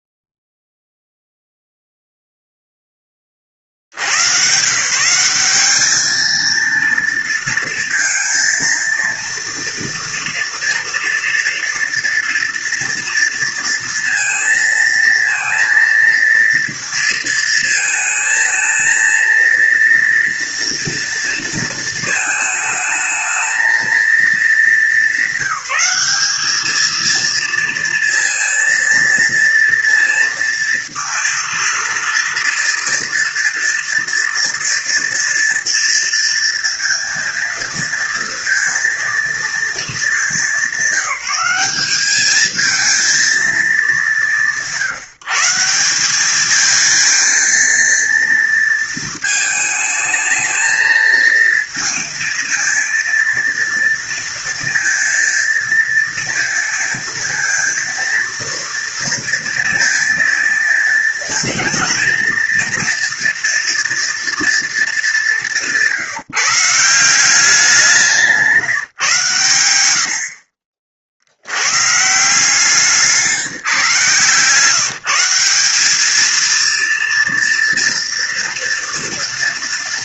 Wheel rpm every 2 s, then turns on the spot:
0, 20, 170, 230, 230, 230, 230, 230, 230, 230, 230, 220, 200, 220, 230, 230, 230, 240, 230, 230, 190, 220, 160, 230, 230, 230, 230, 230, 230, 230, 230, 230, 200, 180, 140, 60, 170, 170, 230, 230.
none